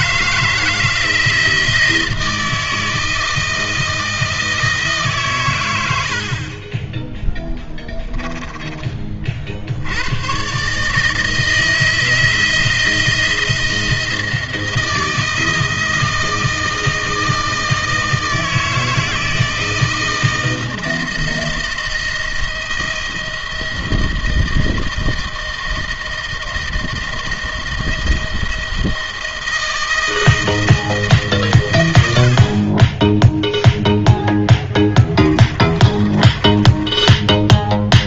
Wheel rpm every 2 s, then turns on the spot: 160, 160, 150, 20, 30, 150, 160, 160, 160, 160, 160, 160, 160, 160, 160, 150, 20, 10, 20.
34-38